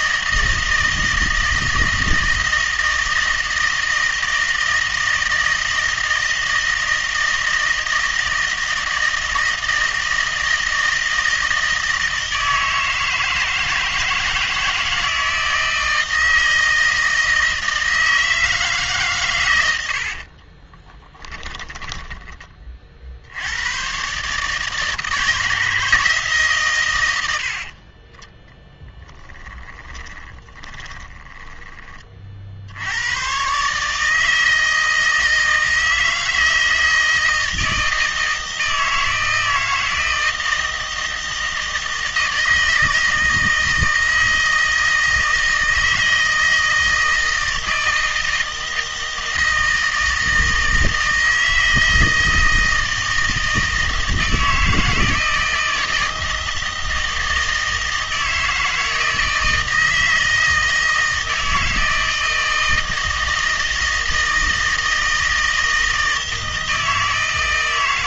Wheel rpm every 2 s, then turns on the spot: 160, 160, 160, 160, 160, 160, 160, 160, 160, 150, 30, 40, 150, 130, 10, 10, 70, 160, 160, 160, 160, 160, 160, 160, 160, 160, 160, 160, 160, 160, 160, 160, 160, 160.
20-22 28-32